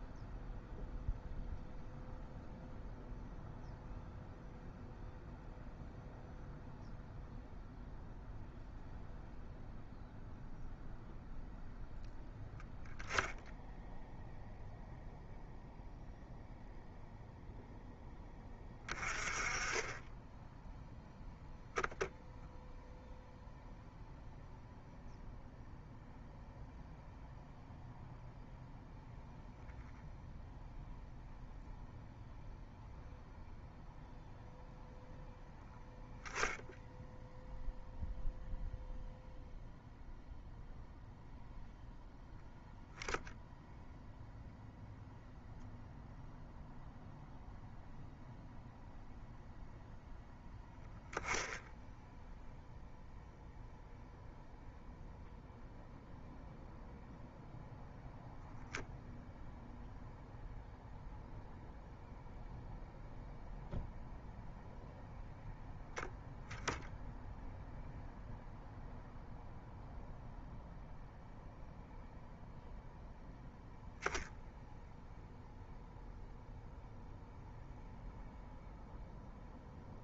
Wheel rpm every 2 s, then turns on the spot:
0, 0, 0, 0, 0, 0, 0, 0, 0, 20, 0, 0, 0, 0, 0, 0, 0, 0, 0, 0, 0, 0, 0, 0, 0, 0, 0, 0, 0, 0, 0, 0, 0, 0, 0, 0, 0, 0, 0, 0.
none